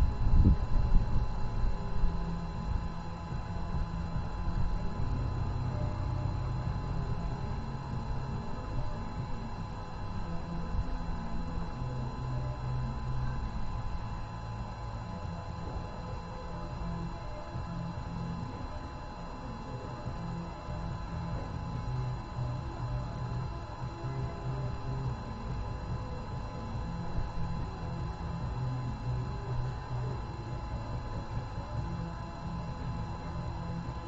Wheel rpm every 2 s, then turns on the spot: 0, 0, 0, 0, 0, 0, 0, 0, 0, 0, 0, 0, 0, 0, 0, 0, 0.
none